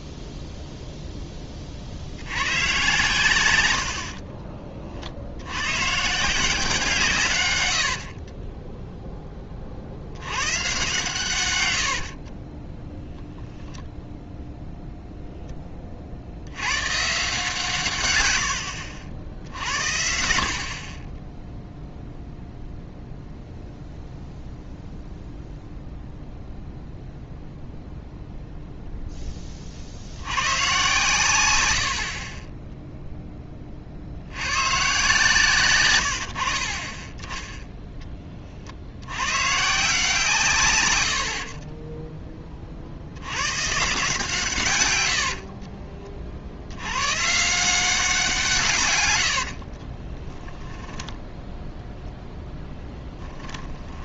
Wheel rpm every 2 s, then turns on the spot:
0, 110, 40, 160, 10, 130, 10, 0, 110, 80, 40, 0, 0, 0, 0, 120, 10, 120, 50, 70, 90, 50, 120, 90, 150, 10, 10.
8-10 12-14 52-54